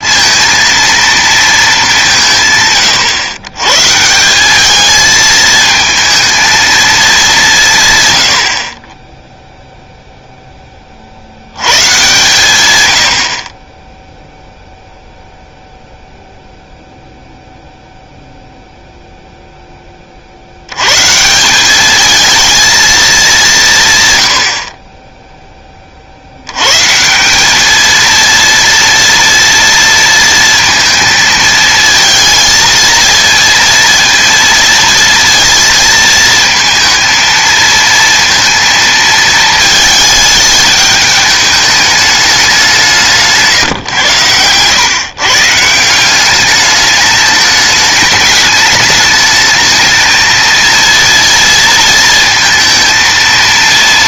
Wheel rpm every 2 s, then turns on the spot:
230, 120, 210, 220, 40, 40, 90, 0, 0, 0, 110, 220, 30, 140, 230, 230, 230, 230, 220, 230, 210, 180, 130, 210, 210, 230, 230.
none